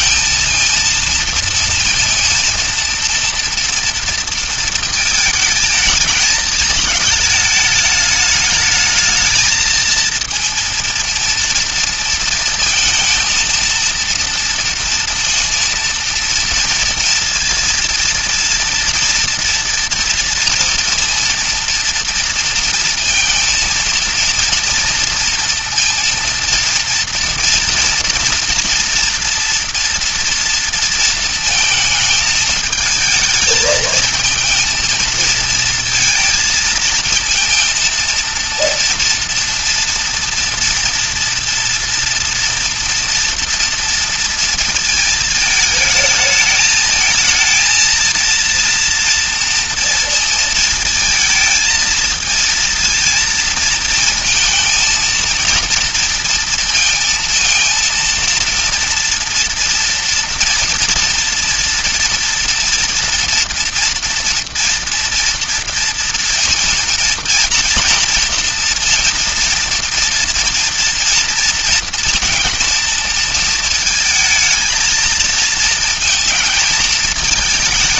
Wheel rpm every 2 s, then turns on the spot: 230, 220, 230, 220, 220, 230, 230, 230, 230, 230, 230, 230, 230, 230, 240, 230, 220, 230, 220, 230, 230, 230, 230, 220, 230, 230, 230, 230, 230, 230, 240, 230, 230, 230, 230, 230, 230, 220, 220.
none